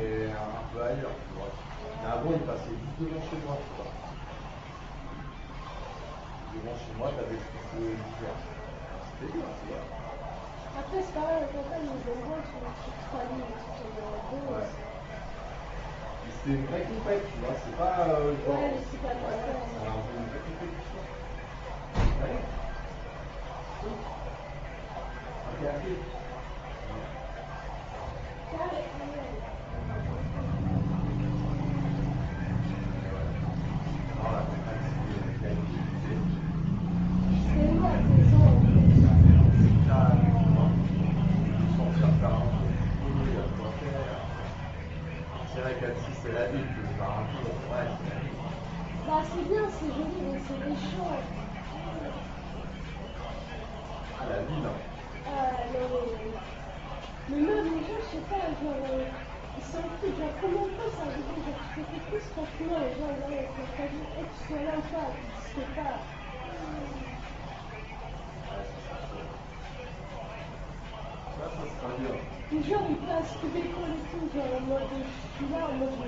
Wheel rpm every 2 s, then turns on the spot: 0, 0, 0, 0, 0, 0, 0, 0, 0, 0, 0, 0, 0, 0, 0, 0, 0, 0, 0, 0, 0, 0, 0, 0, 0, 0, 0, 0, 0, 0, 0, 0, 0, 0, 0, 0, 0, 0.
none